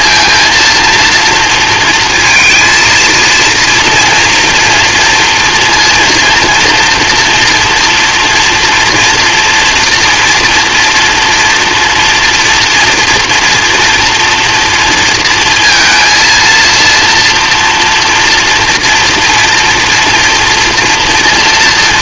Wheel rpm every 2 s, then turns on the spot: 230, 230, 230, 230, 230, 230, 240, 230, 230, 230, 240.
none